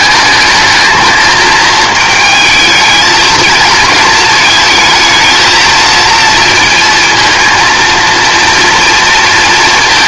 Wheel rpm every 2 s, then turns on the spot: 220, 220, 220, 230, 230.
none